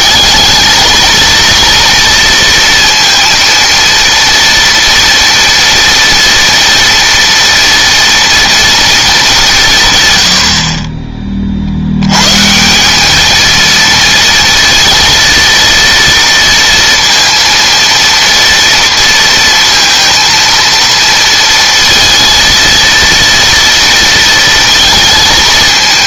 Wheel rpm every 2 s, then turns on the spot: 220, 230, 230, 240, 230, 40, 190, 230, 230, 230, 230, 230, 220.
none